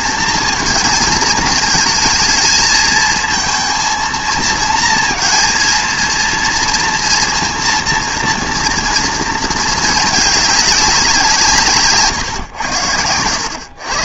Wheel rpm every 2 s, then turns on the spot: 220, 220, 230, 230, 230, 200, 110.
none